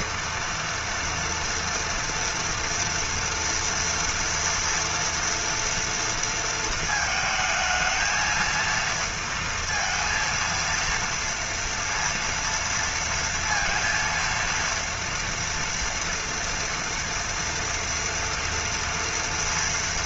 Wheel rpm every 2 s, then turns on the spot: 230, 240, 230, 230, 230, 230, 230, 230, 230, 230.
none